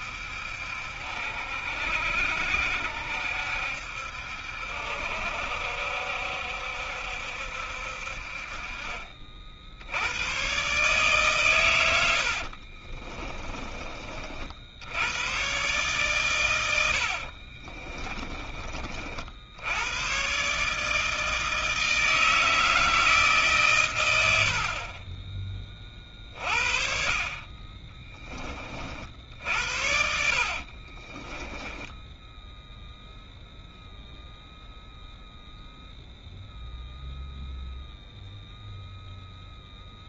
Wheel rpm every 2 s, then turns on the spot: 70, 70, 70, 70, 40, 130, 50, 60, 90, 30, 140, 160, 60, 40, 40, 40, 0, 0, 0, 0.
12-14 24-26 30-32